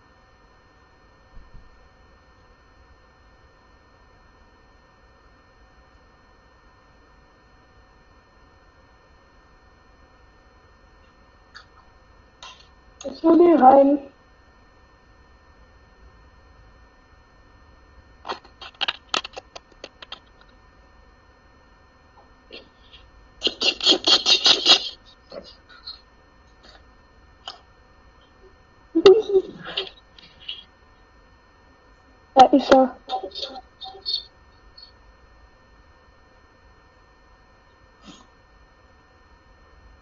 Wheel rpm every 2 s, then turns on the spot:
0, 0, 0, 0, 0, 0, 0, 0, 0, 0, 0, 0, 0, 0, 0, 0, 0, 0, 0, 0.
none